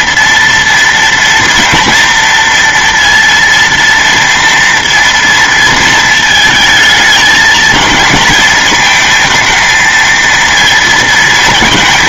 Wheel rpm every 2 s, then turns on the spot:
230, 230, 230, 220, 220, 230.
none